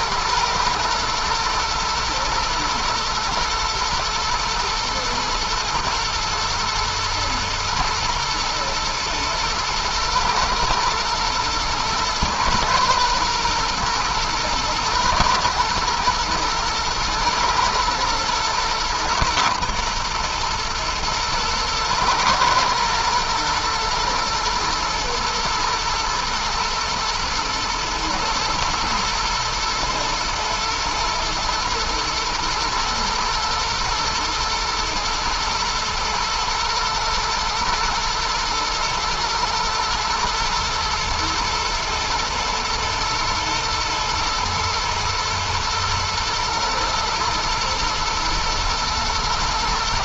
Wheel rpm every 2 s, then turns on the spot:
110, 120, 120, 110, 120, 120, 120, 110, 110, 110, 120, 120, 120, 110, 120, 110, 110, 120, 120, 110, 110, 120, 110, 110, 120.
none